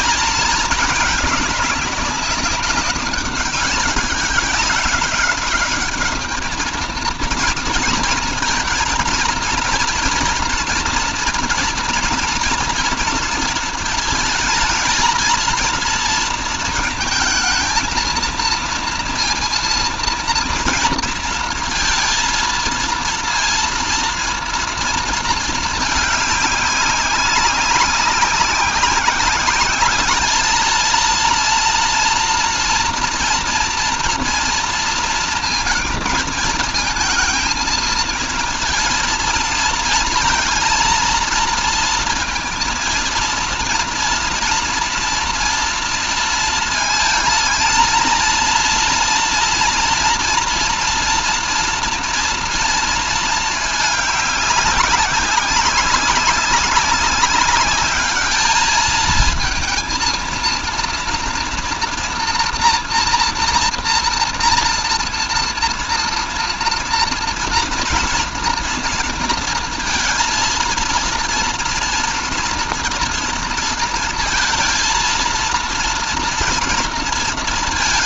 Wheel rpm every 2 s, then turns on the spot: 220, 200, 190, 220, 230, 230, 230, 220, 220, 230, 230, 230, 230, 200, 190, 220, 240, 230, 230, 230, 230, 230, 230, 230, 230, 240, 230, 200, 200, 220, 230, 240, 230, 230, 230, 230, 230, 230, 230.
none